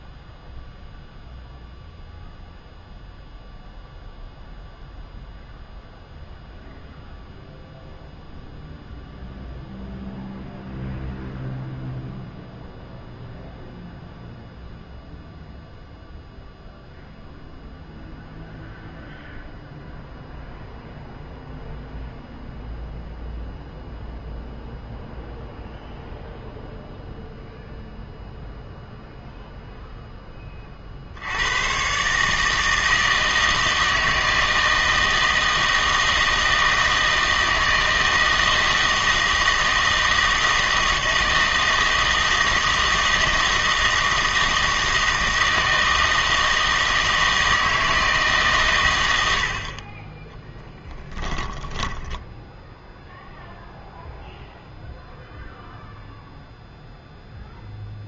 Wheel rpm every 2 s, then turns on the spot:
0, 0, 0, 0, 0, 0, 0, 0, 0, 0, 0, 0, 0, 0, 0, 20, 160, 160, 160, 160, 160, 160, 160, 160, 130, 10, 0, 0, 0.
50-52